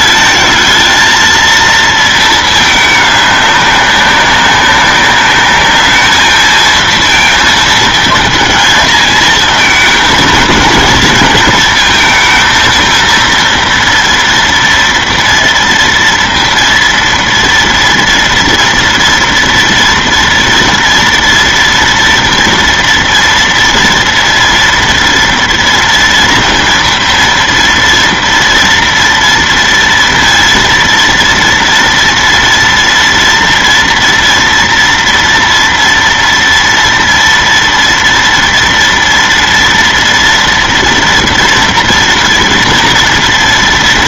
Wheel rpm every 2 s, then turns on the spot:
220, 210, 200, 230, 220, 230, 230, 230, 230, 230, 230, 230, 230, 230, 230, 230, 230, 230, 230, 230, 230, 230.
none